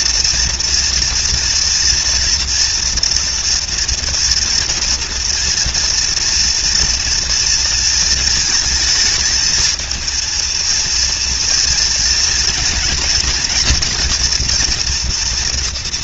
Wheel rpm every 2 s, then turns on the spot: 230, 230, 230, 230, 220, 230, 230, 230.
none